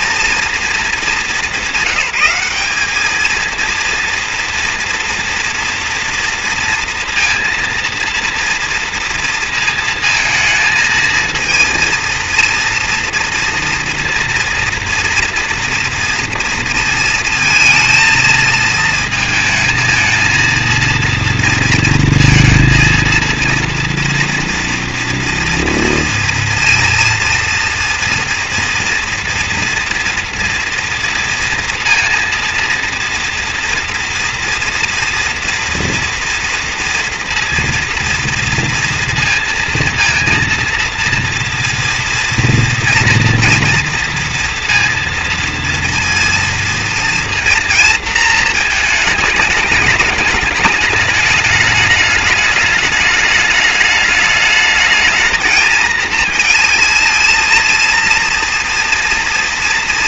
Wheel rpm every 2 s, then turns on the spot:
220, 200, 240, 230, 230, 220, 240, 240, 230, 220, 230, 230, 230, 230, 230, 230, 230, 230, 230, 230, 230, 230, 230, 230, 220, 210, 210, 220, 230, 230.
none